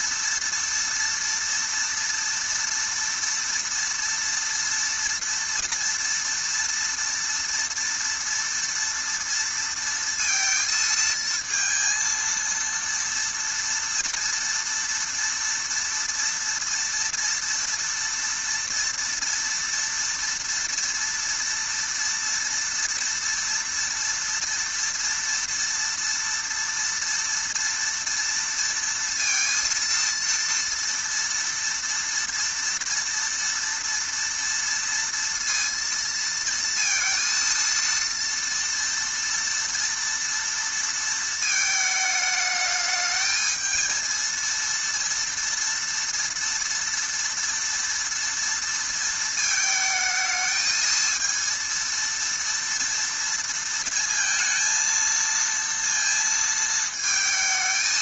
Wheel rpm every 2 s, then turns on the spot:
230, 230, 230, 230, 230, 230, 230, 230, 230, 230, 230, 230, 230, 240, 230, 230, 230, 230, 230, 230, 230, 210, 230, 230, 230, 220, 230, 230, 220.
none